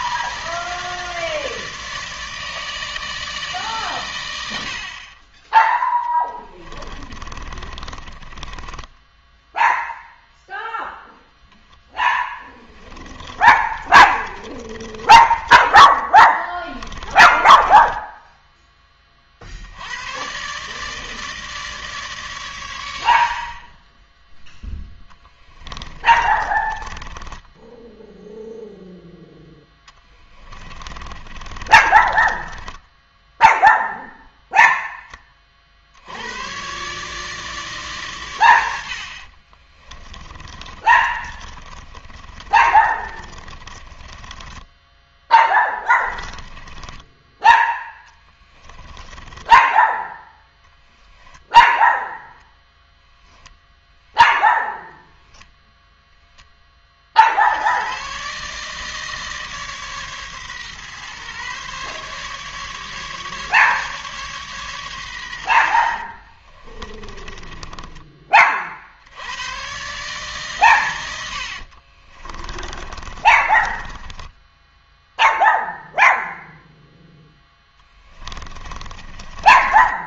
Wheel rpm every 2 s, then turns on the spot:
160, 150, 80, 20, 20, 0, 20, 30, 20, 10, 130, 120, 0, 20, 0, 20, 20, 0, 110, 110, 30, 30, 20, 20, 20, 10, 0, 0, 10, 140, 130, 140, 140, 40, 30, 140, 30, 10, 0, 20.
6-10 12-18 26-28 30-34 40-50 66-68 72-76 78-80